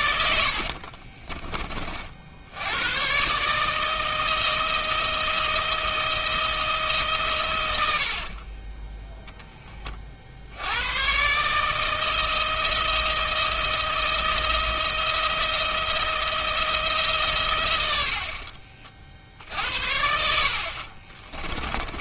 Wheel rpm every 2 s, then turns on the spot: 50, 90, 160, 160, 20, 90, 160, 160, 160, 40, 50.
0-2 8-10